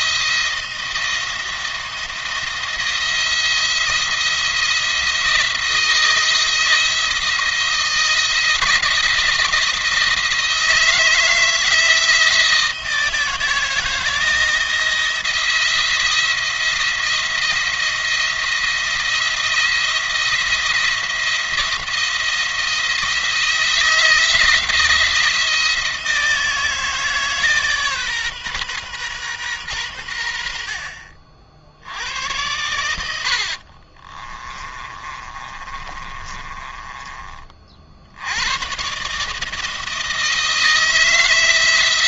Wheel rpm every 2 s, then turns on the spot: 170, 160, 170, 170, 170, 170, 160, 170, 170, 170, 170, 170, 170, 160, 130, 70, 90, 30, 20, 120, 160.
34-38